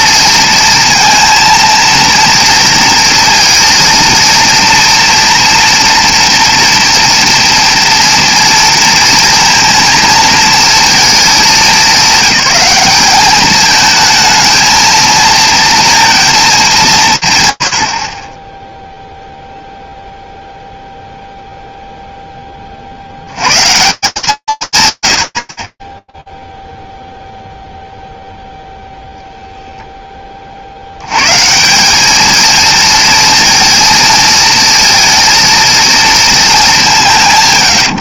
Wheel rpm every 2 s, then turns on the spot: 230, 230, 230, 240, 230, 220, 200, 220, 210, 0, 0, 60, 180, 0, 0, 50, 230, 230, 200.
none